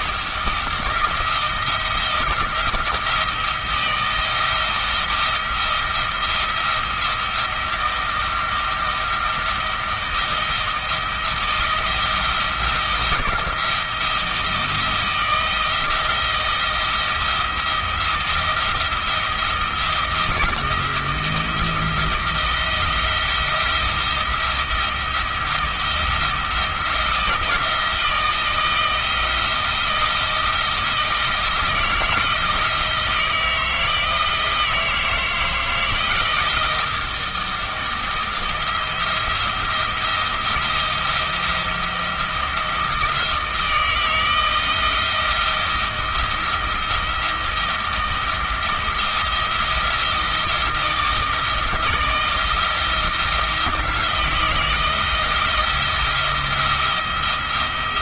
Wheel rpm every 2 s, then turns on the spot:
170, 170, 170, 170, 170, 160, 170, 160, 170, 170, 170, 170, 170, 170, 160, 170, 160, 160, 170, 170, 170, 170, 170, 170, 160, 170, 170, 170, 170.
none